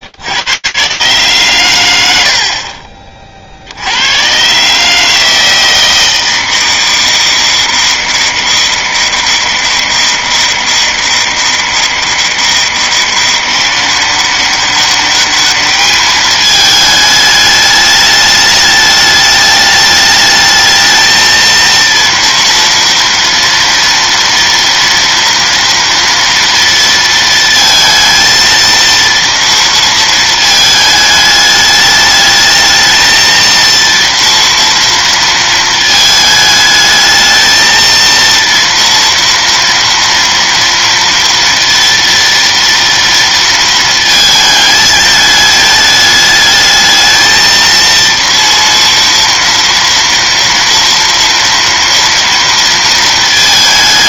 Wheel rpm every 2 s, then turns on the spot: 50, 90, 100, 160, 160, 160, 160, 190, 220, 210, 210, 230, 230, 230, 230, 230, 210, 230, 220, 230, 230, 230, 220, 210, 230, 230, 230.
none